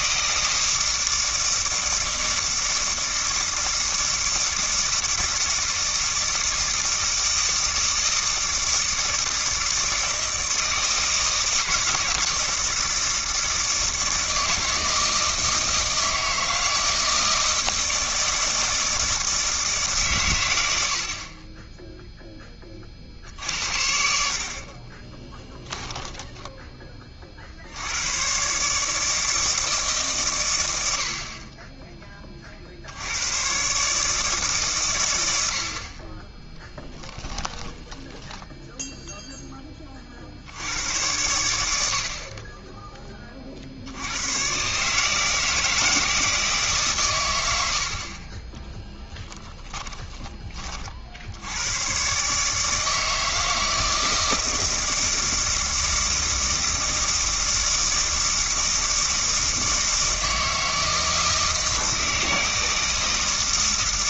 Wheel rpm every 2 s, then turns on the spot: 160, 160, 160, 160, 160, 170, 170, 160, 160, 160, 70, 40, 30, 20, 150, 90, 70, 130, 20, 10, 90, 10, 150, 140, 20, 50, 160, 160, 160, 160, 160, 160.
24-26 36-38 48-50